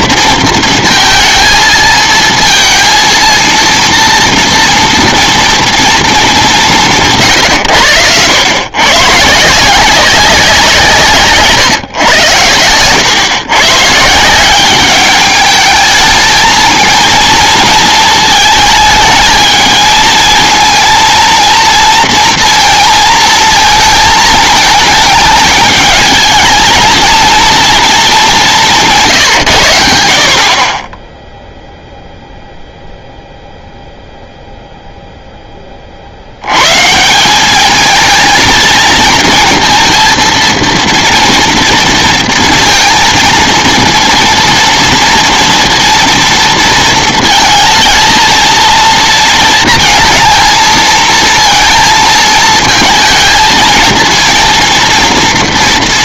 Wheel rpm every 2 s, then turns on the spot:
230, 230, 240, 180, 110, 180, 110, 190, 220, 220, 220, 230, 220, 220, 180, 30, 0, 0, 120, 230, 230, 230, 230, 230, 230, 220, 220, 230.
none